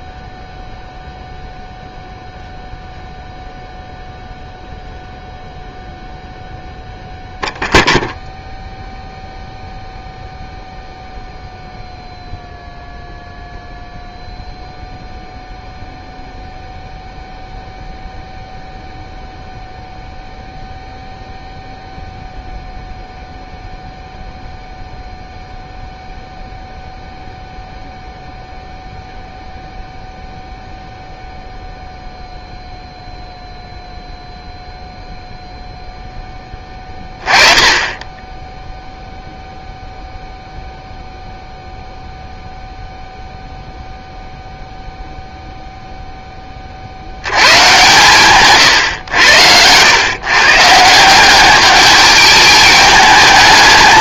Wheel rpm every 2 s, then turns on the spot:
0, 0, 0, 0, 0, 0, 0, 0, 0, 0, 0, 0, 0, 0, 0, 0, 0, 0, 20, 0, 0, 0, 0, 50, 130, 160, 210.
none